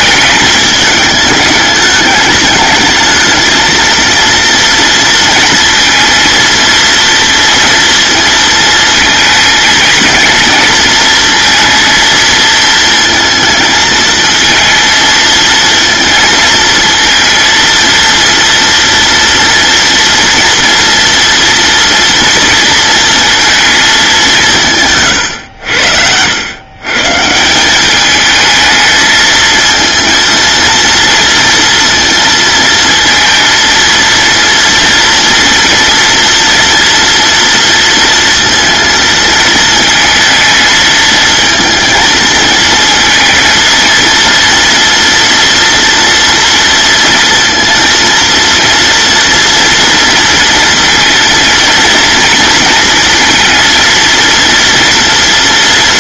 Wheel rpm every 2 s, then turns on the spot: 220, 220, 230, 230, 230, 230, 230, 230, 230, 230, 230, 230, 130, 140, 220, 230, 230, 230, 230, 220, 220, 230, 230, 230, 230, 230, 230, 230.
none